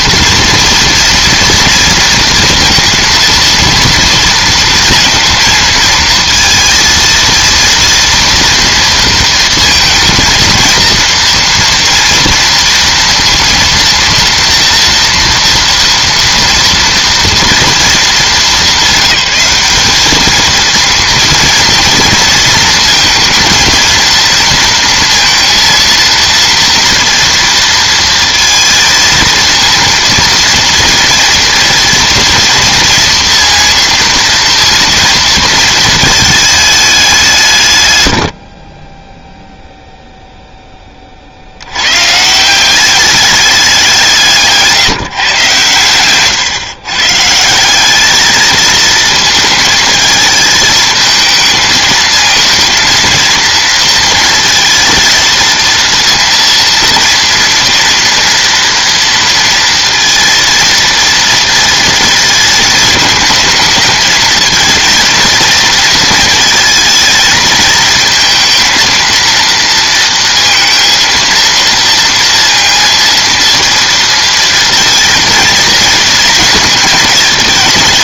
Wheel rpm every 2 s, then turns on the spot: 230, 230, 230, 230, 230, 230, 230, 230, 230, 200, 230, 220, 230, 230, 230, 230, 230, 230, 170, 0, 30, 200, 150, 140, 220, 220, 230, 230, 230, 230, 230, 220, 230, 230, 230, 230, 230, 230, 220.
none